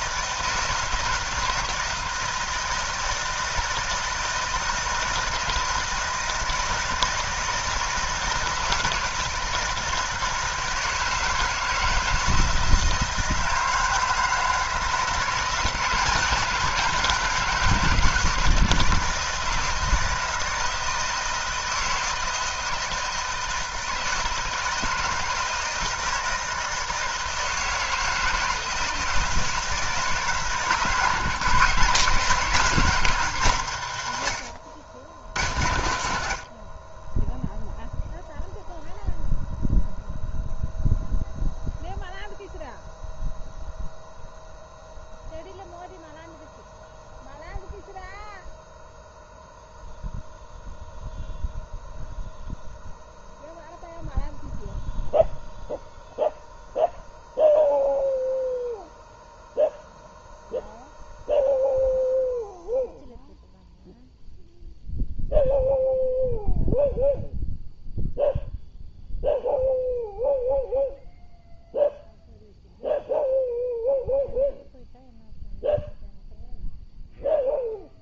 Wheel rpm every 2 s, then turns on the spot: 160, 160, 160, 160, 160, 160, 160, 160, 170, 160, 160, 160, 160, 160, 160, 150, 160, 110, 50, 0, 0, 0, 0, 0, 0, 0, 0, 0, 0, 0, 0, 0, 0, 0, 0, 0, 0, 0, 0.
none